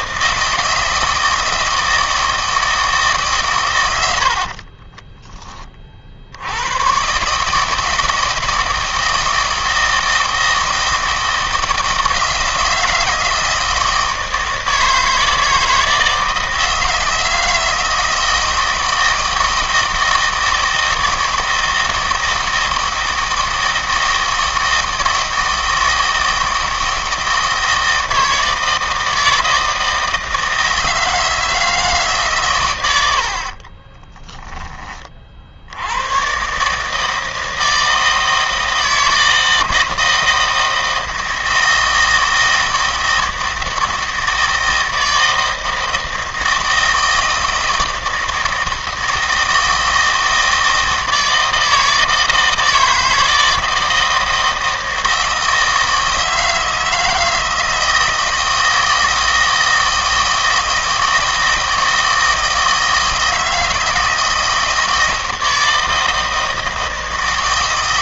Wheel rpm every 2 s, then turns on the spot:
160, 160, 40, 100, 160, 160, 160, 160, 160, 160, 160, 160, 160, 160, 160, 160, 110, 20, 150, 160, 160, 160, 160, 160, 160, 160, 160, 160, 160, 160, 160, 160, 160, 160.
4-6